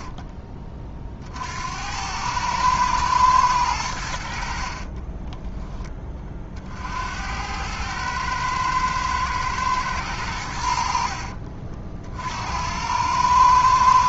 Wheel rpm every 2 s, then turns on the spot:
50, 110, 20, 80, 110, 60, 100.
4-6